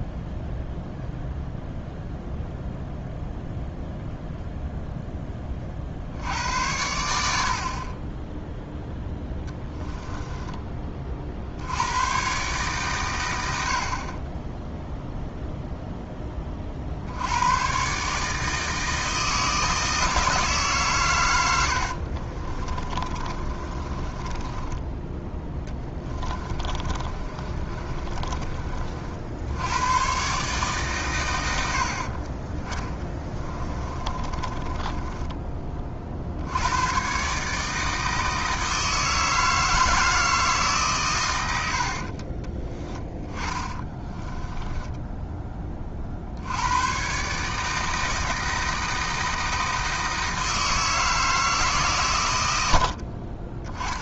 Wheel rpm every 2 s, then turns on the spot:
0, 0, 0, 80, 0, 20, 120, 0, 40, 160, 140, 30, 10, 30, 40, 140, 20, 20, 100, 160, 150, 20, 10, 100, 160, 160, 80.
22-28 34-36 42-46 52-54